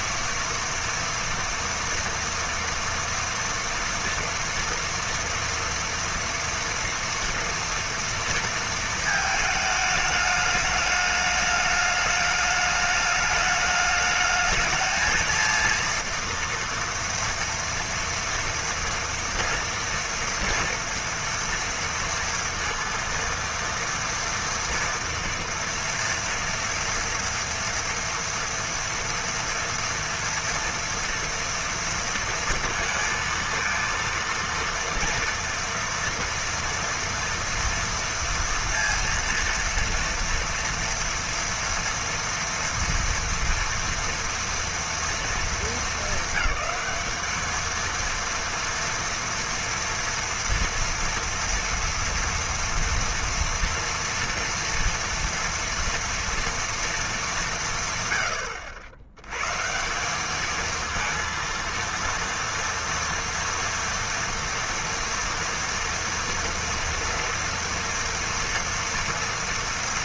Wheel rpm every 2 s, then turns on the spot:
230, 230, 230, 230, 220, 210, 210, 220, 230, 230, 230, 230, 230, 230, 230, 230, 230, 230, 230, 230, 240, 240, 230, 220, 230, 230, 230, 230, 210, 100, 230, 230, 240, 230, 230.
none